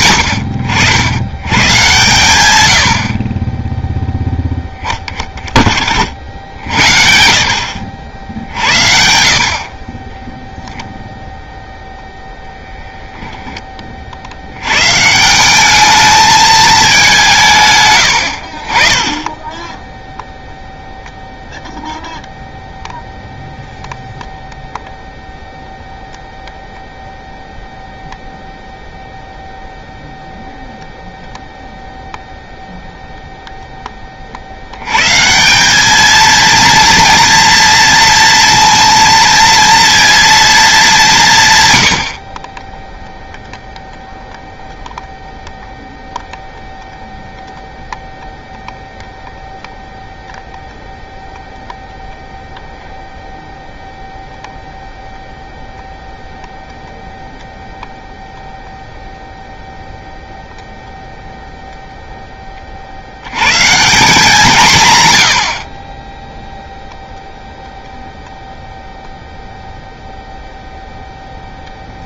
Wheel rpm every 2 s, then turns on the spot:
90, 80, 0, 70, 60, 0, 0, 160, 180, 20, 0, 0, 0, 0, 0, 0, 0, 140, 230, 230, 170, 0, 0, 0, 0, 0, 0, 0, 0, 0, 0, 50, 140, 0, 0, 0.
none